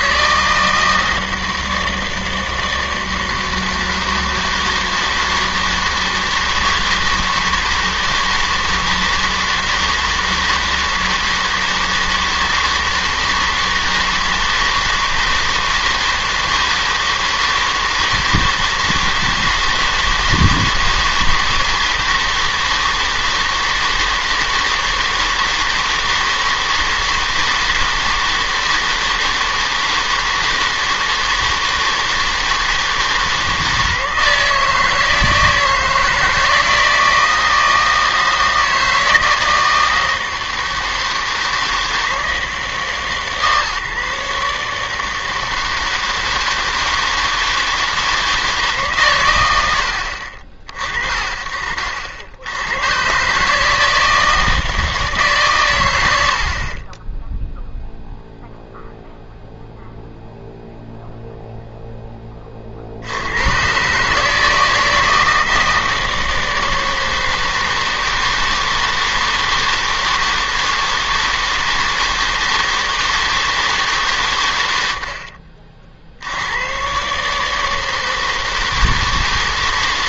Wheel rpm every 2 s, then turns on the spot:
160, 160, 160, 160, 160, 160, 160, 160, 160, 160, 160, 160, 160, 160, 160, 160, 160, 160, 160, 160, 160, 160, 160, 160, 150, 30, 110, 160, 30, 0, 0, 60, 160, 160, 160, 160, 160, 80, 130, 160.
none